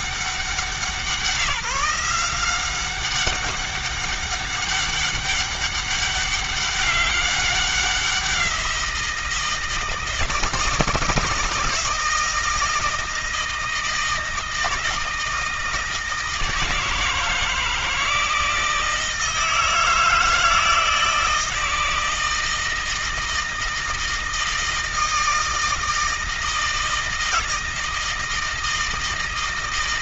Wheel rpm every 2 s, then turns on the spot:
190, 190, 200, 200, 180, 170, 160, 160, 160, 160, 160, 160, 160, 160, 160.
none